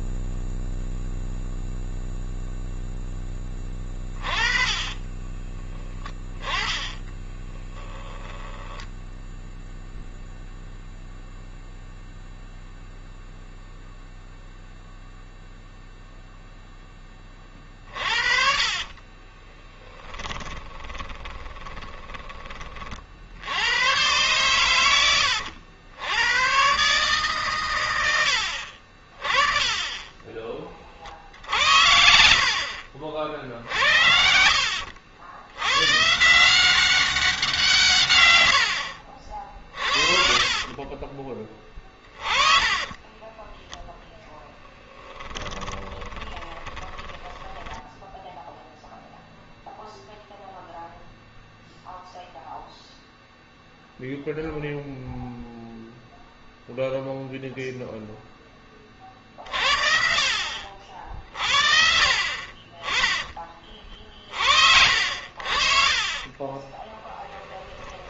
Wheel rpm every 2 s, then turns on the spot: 0, 0, 40, 20, 10, 0, 0, 0, 0, 40, 20, 30, 110, 110, 60, 30, 70, 60, 170, 70, 30, 20, 10, 20, 0, 0, 0, 0, 0, 20, 50, 40, 60, 30.
4-10 18-22 34-36 40-48 66-68